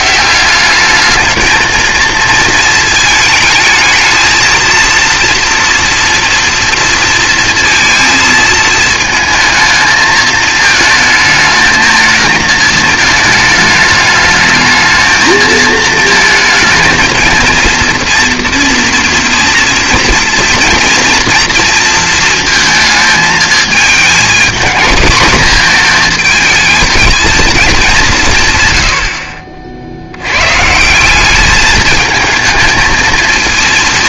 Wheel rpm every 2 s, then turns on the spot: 190, 220, 230, 230, 220, 220, 220, 220, 220, 240, 240, 230, 230, 220, 120, 140, 220.
none